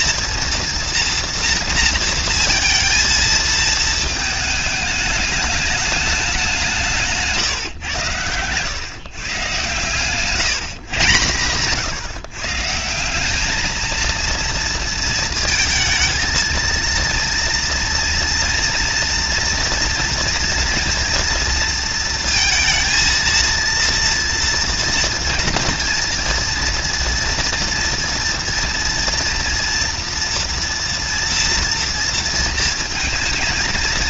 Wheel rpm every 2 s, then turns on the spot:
230, 220, 210, 160, 130, 130, 190, 230, 230, 230, 230, 230, 230, 230, 230, 230, 230.
none